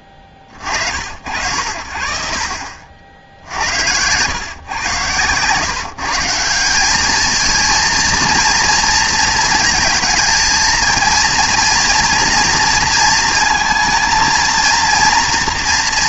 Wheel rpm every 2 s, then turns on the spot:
40, 50, 120, 190, 230, 230, 230, 230.
none